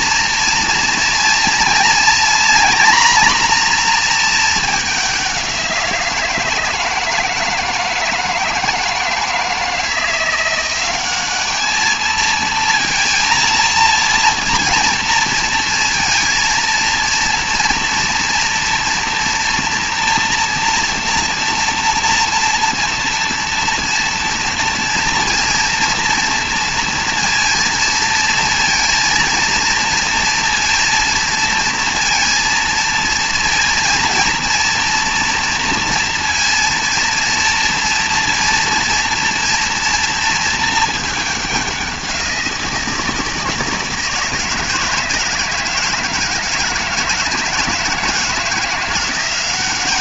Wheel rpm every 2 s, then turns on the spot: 230, 240, 210, 170, 160, 190, 230, 230, 230, 230, 230, 230, 230, 230, 230, 230, 230, 230, 230, 240, 220, 170, 160, 160, 170.
none